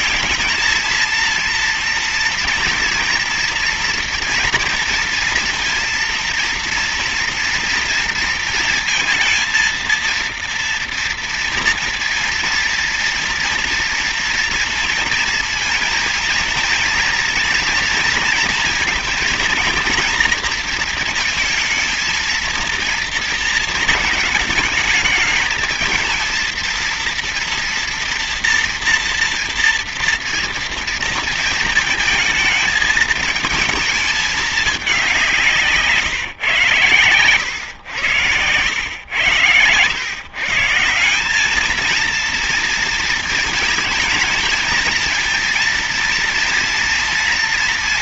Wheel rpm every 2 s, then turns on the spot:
220, 230, 230, 230, 230, 240, 230, 240, 230, 220, 230, 220, 210, 230, 230, 230, 220, 210, 120, 90, 150, 230, 220, 230.
none